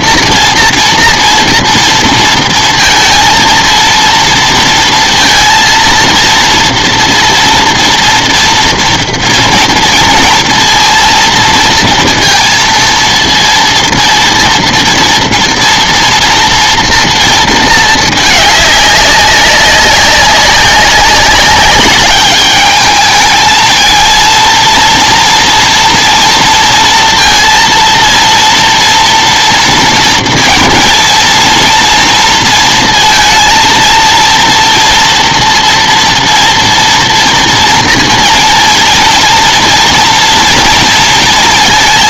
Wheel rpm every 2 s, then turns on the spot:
230, 230, 230, 230, 230, 230, 230, 230, 230, 200, 200, 210, 230, 230, 230, 230, 230, 230, 230, 230, 230.
none